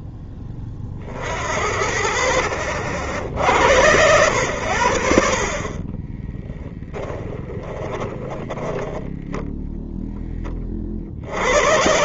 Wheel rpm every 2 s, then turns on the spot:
10, 60, 90, 20, 20, 20.
6-10